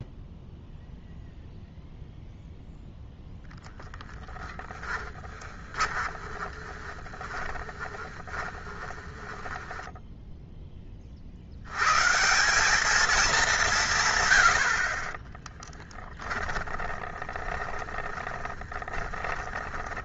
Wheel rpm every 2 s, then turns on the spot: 0, 0, 10, 20, 30, 10, 180, 90, 30, 20.
6-10 16-20